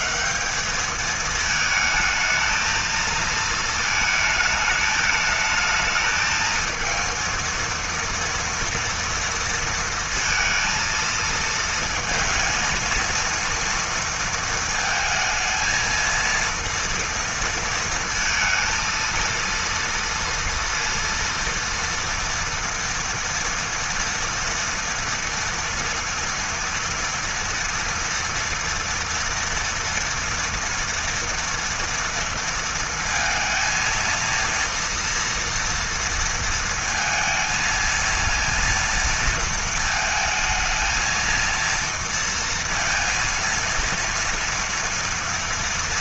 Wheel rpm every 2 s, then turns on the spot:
220, 230, 220, 230, 230, 230, 230, 230, 230, 230, 230, 230, 240, 240, 230, 230, 230, 230, 230, 230, 230, 230, 230.
none